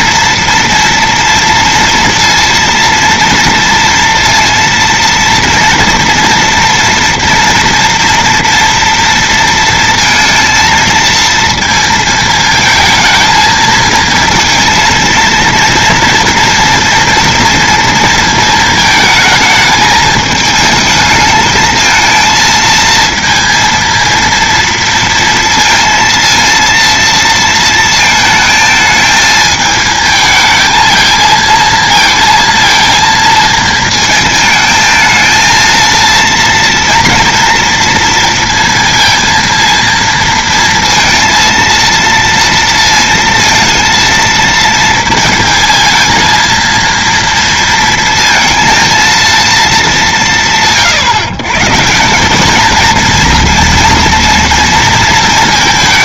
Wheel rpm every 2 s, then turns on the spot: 230, 230, 230, 230, 230, 230, 220, 230, 230, 220, 220, 230, 230, 230, 220, 220, 230, 220, 230, 230, 230, 230, 230, 230, 230, 150, 230, 230.
none